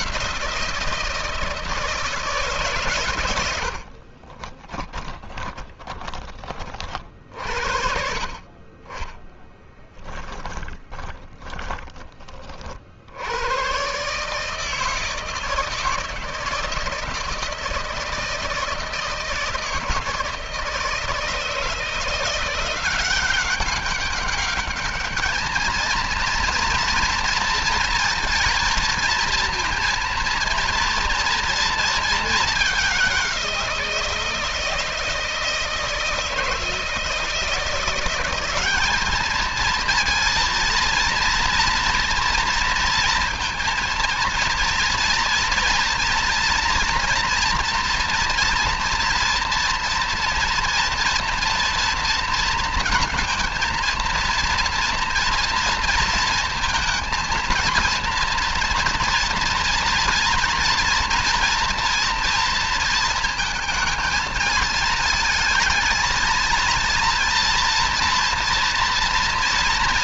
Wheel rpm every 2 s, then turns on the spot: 170, 120, 20, 40, 30, 20, 60, 160, 160, 160, 160, 180, 210, 230, 230, 230, 210, 170, 160, 210, 230, 230, 230, 230, 230, 230, 230, 230, 230, 230, 240, 230, 220, 230, 230.
4-6 10-12